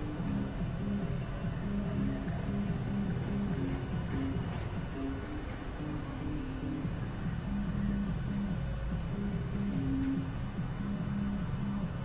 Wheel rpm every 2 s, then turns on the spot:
0, 0, 0, 0, 0, 0.
none